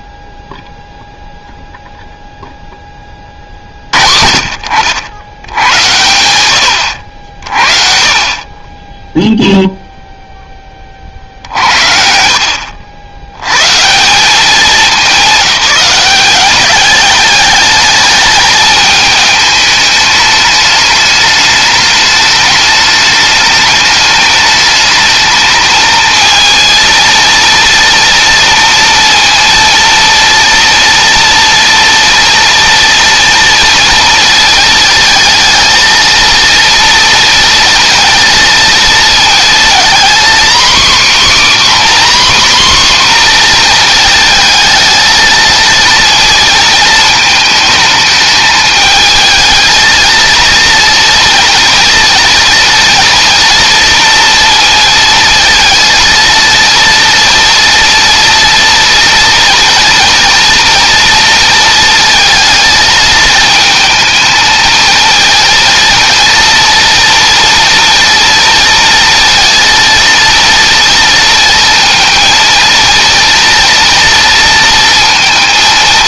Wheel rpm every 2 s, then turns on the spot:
0, 0, 60, 90, 20, 20, 70, 200, 190, 210, 210, 210, 210, 230, 230, 230, 230, 230, 230, 230, 260, 260, 220, 220, 220, 230, 230, 230, 230, 230, 230, 220, 220, 230, 230, 230, 230, 230.
none